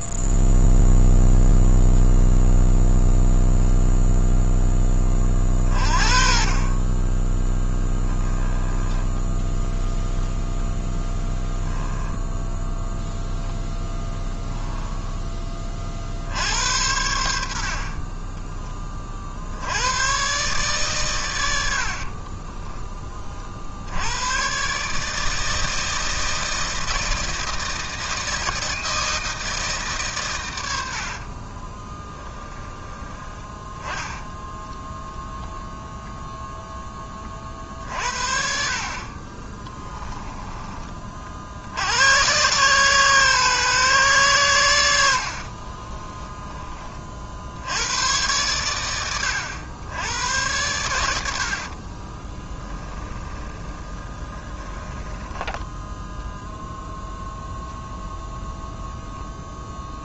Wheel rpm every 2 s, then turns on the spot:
0, 0, 20, 20, 10, 0, 0, 10, 80, 30, 130, 20, 150, 160, 160, 60, 20, 0, 20, 50, 30, 130, 80, 40, 100, 100, 20, 10, 0, 0.
30-34 52-56